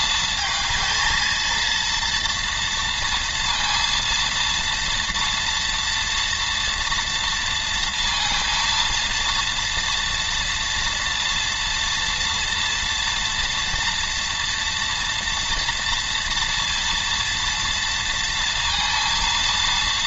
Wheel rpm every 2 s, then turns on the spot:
220, 230, 230, 240, 230, 230, 230, 240, 230, 230.
none